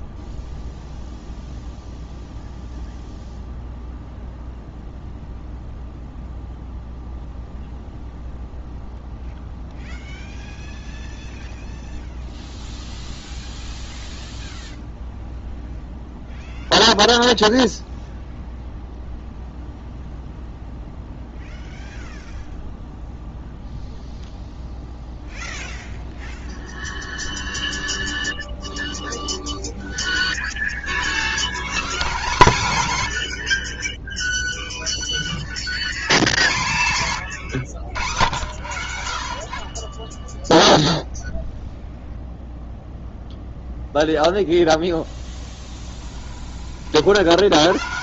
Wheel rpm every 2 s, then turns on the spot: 0, 0, 0, 0, 0, 0, 0, 0, 0, 0, 0, 0, 0, 0, 0, 30, 130, 0, 110, 80, 0, 0, 10, 30.
38-40